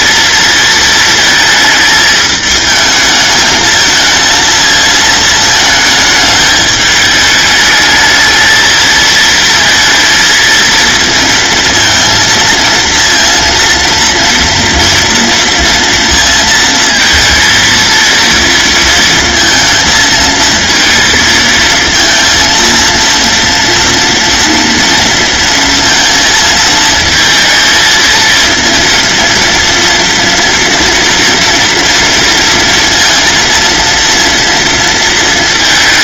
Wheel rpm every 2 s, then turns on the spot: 220, 220, 230, 210, 220, 230, 230, 230, 230, 230, 230, 230, 230, 220, 230, 240, 230, 230.
none